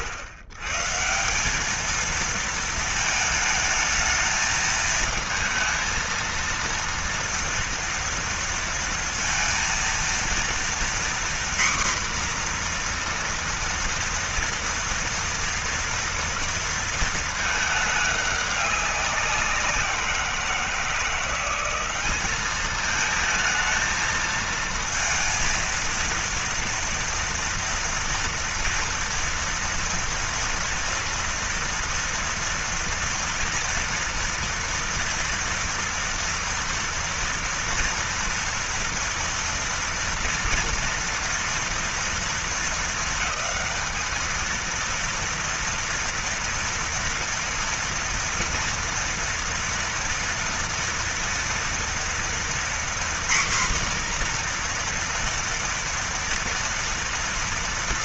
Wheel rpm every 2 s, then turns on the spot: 120, 220, 220, 230, 230, 240, 240, 230, 230, 200, 170, 210, 230, 230, 240, 230, 230, 240, 230, 230, 230, 220, 230, 230, 230, 230, 240, 240, 230.
none